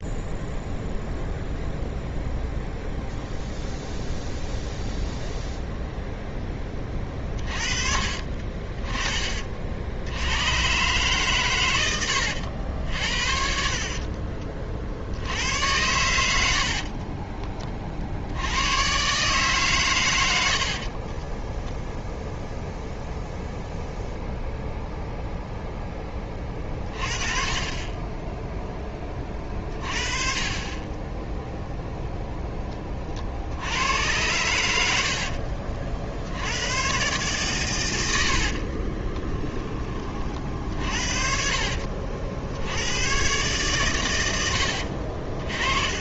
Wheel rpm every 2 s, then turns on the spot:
0, 0, 0, 20, 30, 110, 80, 50, 60, 90, 70, 0, 0, 30, 10, 30, 20, 90, 100, 50, 50, 80, 70.
16-18 20-22 38-42 44-46